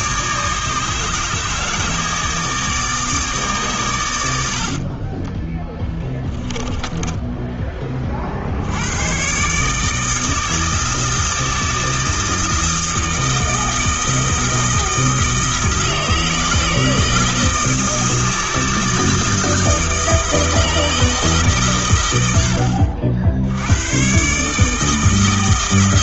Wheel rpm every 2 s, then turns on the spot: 150, 150, 30, 10, 100, 160, 160, 160, 160, 160, 160, 70, 160.
4-8